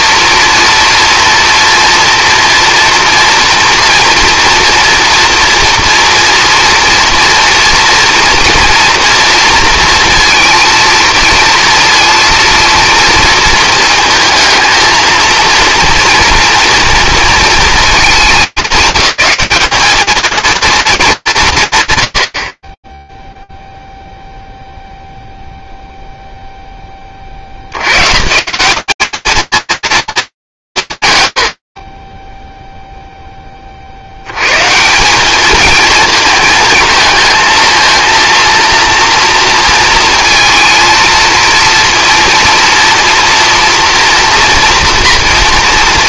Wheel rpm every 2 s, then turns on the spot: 240, 230, 230, 230, 240, 230, 230, 230, 230, 210, 230, 40, 0, 20, 180, 170, 0, 140, 220, 230, 230, 230, 230.
none